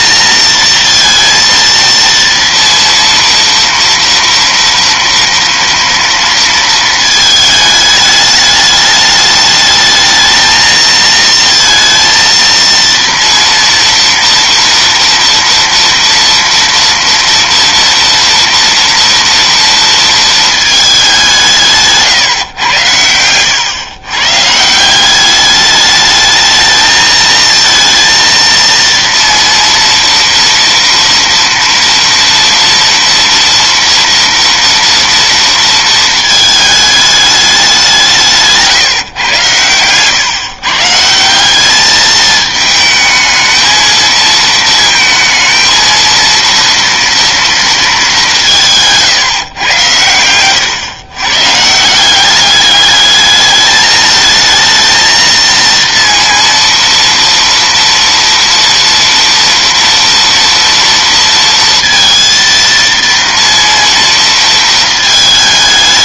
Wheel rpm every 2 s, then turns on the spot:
230, 230, 230, 230, 210, 220, 230, 230, 240, 230, 210, 120, 160, 220, 230, 230, 230, 230, 220, 150, 140, 220, 220, 230, 170, 110, 200, 220, 230, 230, 230, 230, 230.
none